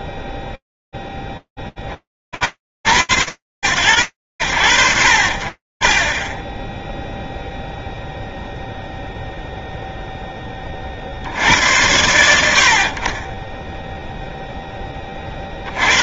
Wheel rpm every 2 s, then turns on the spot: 20, 100, 50, 0, 0, 90, 10, 100.
none